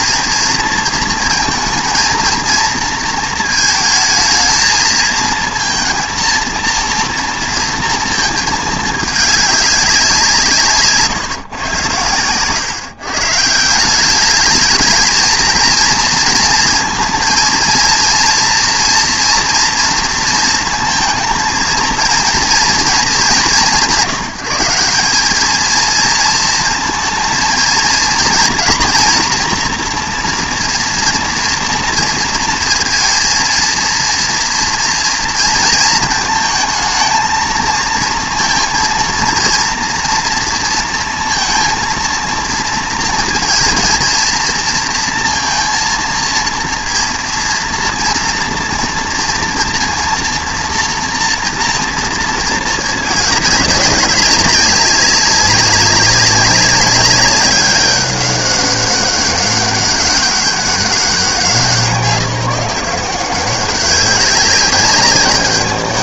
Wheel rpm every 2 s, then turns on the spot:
230, 230, 230, 230, 220, 160, 130, 210, 230, 240, 230, 220, 180, 230, 240, 230, 230, 230, 220, 230, 230, 230, 230, 230, 230, 230, 220, 200, 200, 200, 190, 180, 200.
none